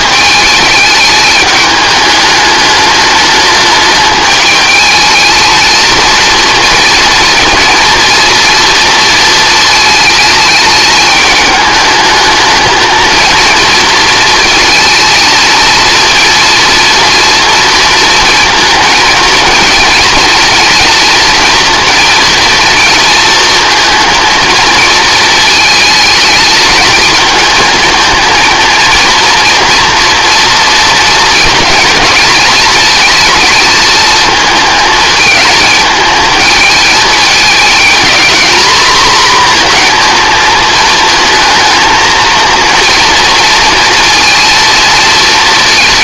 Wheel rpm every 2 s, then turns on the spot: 210, 210, 220, 230, 230, 210, 220, 220, 230, 230, 230, 230, 230, 220, 230, 230, 230, 220, 220, 230, 220, 230, 230.
none